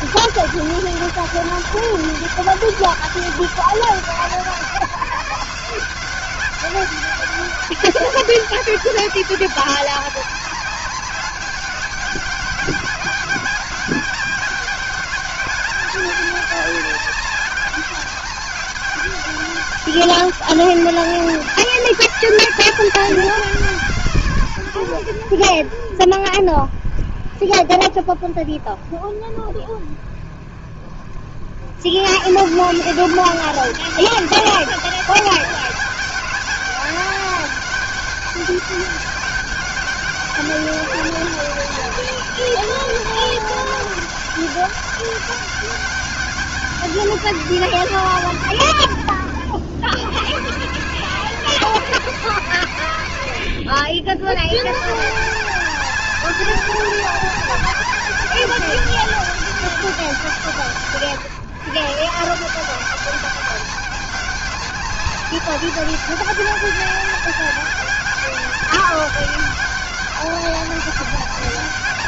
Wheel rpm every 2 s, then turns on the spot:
200, 190, 180, 200, 200, 200, 200, 190, 200, 200, 200, 190, 80, 40, 30, 50, 190, 200, 200, 200, 200, 200, 200, 180, 90, 150, 100, 150, 200, 200, 140, 190, 200, 200, 200, 200.
none